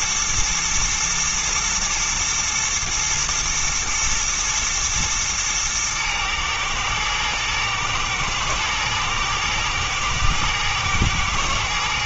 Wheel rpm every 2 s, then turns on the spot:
110, 120, 120, 110, 110, 110.
none